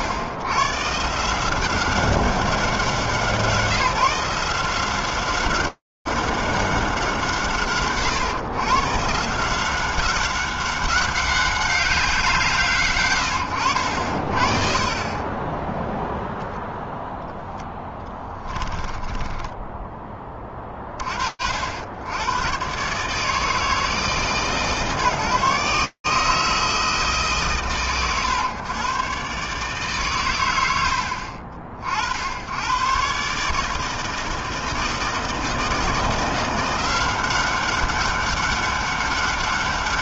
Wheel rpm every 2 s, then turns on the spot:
110, 180, 170, 180, 140, 190, 140, 60, 0, 10, 20, 110, 150, 160, 120, 130, 90, 160, 170, 200.
18-20